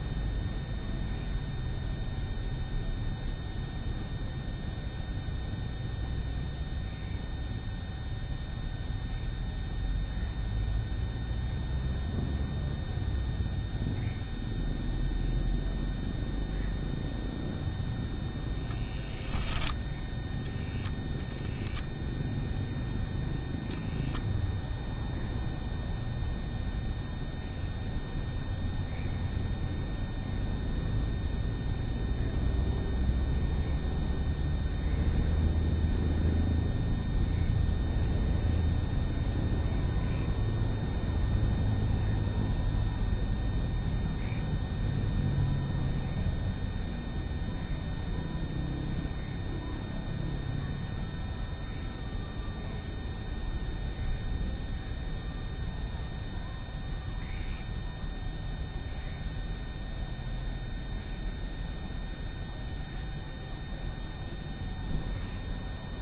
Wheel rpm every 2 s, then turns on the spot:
0, 0, 0, 0, 0, 0, 0, 0, 0, 0, 0, 0, 0, 0, 0, 0, 0, 0, 0, 0, 0, 0, 0, 0, 0, 0, 0, 0, 0, 0, 0, 0, 0.
none